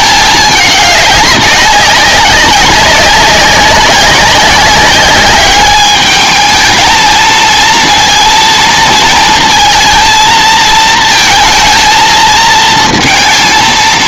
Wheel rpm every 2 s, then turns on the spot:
210, 190, 200, 220, 230, 230, 230.
none